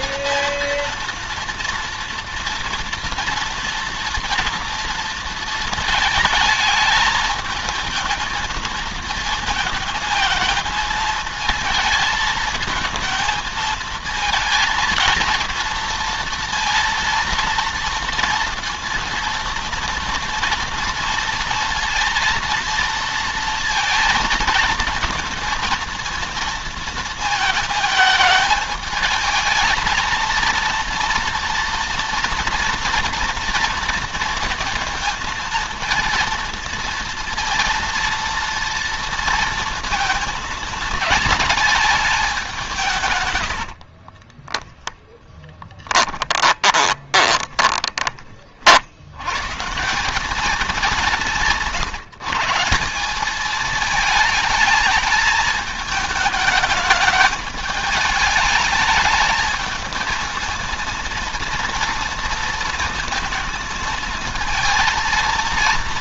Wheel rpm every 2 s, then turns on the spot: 230, 230, 230, 220, 220, 220, 230, 230, 230, 230, 230, 230, 230, 230, 220, 230, 230, 230, 230, 230, 220, 140, 10, 30, 90, 180, 190, 220, 210, 210, 230, 230, 230.
44-48